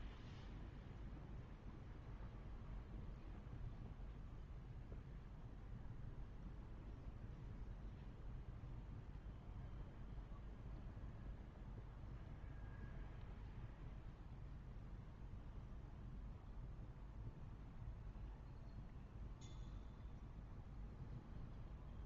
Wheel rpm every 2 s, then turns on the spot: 0, 0, 0, 0, 0, 0, 0, 0, 0, 0, 0.
none